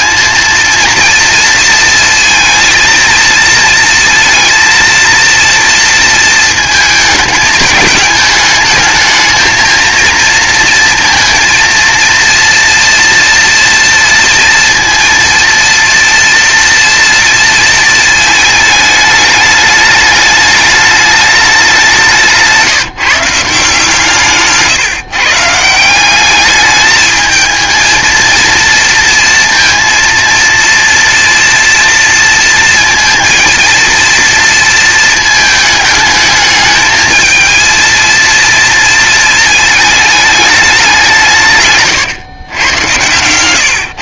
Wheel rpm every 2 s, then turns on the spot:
230, 230, 230, 220, 220, 230, 240, 230, 230, 220, 210, 170, 150, 210, 230, 240, 230, 230, 220, 230, 190, 110.
42-44